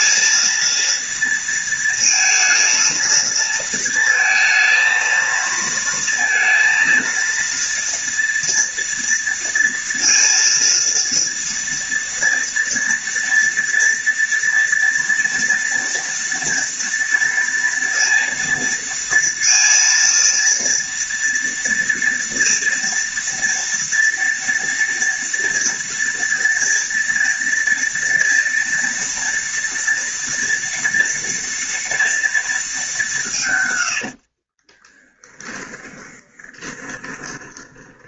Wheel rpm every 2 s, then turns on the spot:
230, 230, 230, 230, 240, 230, 230, 230, 230, 230, 230, 230, 230, 230, 230, 230, 220, 40, 30.
34-38